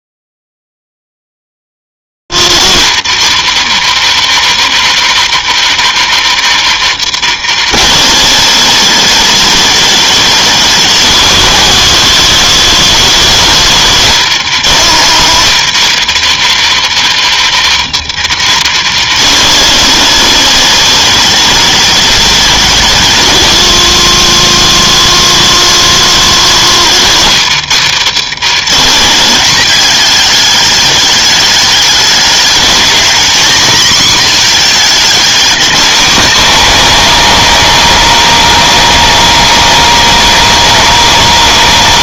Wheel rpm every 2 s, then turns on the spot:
160, 130, 160, 180, 140, 170, 140, 120, 140, 150, 130, 160, 130, 120, 140, 180, 210, 230, 220, 250, 240.
none